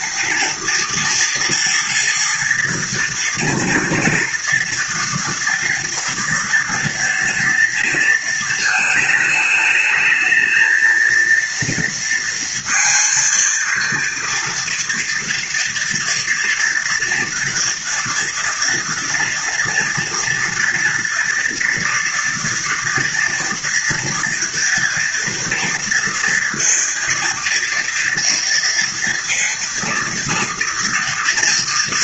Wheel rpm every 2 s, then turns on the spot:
230, 230, 230, 230, 230, 220, 230, 230, 230, 230, 230, 230, 230, 230, 230, 230.
none